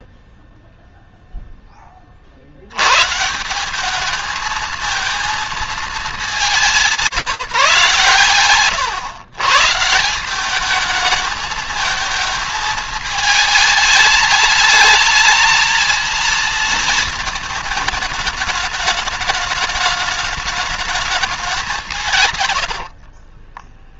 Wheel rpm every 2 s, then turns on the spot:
0, 60, 220, 200, 120, 200, 220, 210, 230, 210, 210, 110.
22-24